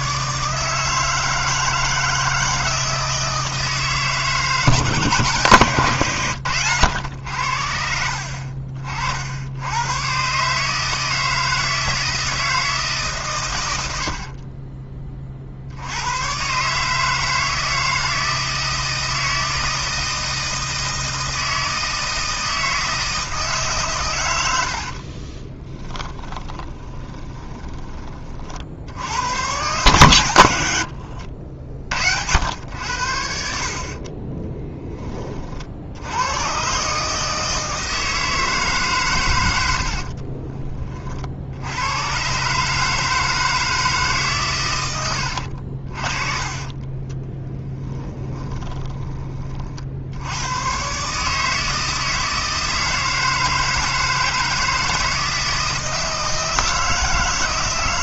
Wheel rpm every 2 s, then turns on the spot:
160, 160, 160, 100, 50, 150, 160, 30, 140, 160, 160, 160, 80, 20, 70, 100, 90, 20, 130, 150, 40, 140, 110, 30, 20, 110, 160, 160, 160.
14-16 24-28 30-32 46-50